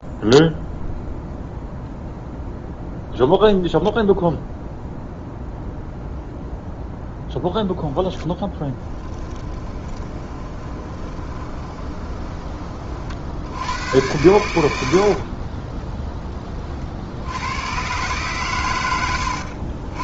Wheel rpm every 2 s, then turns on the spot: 0, 0, 0, 0, 10, 30, 30, 80, 40, 110.
10-12 14-16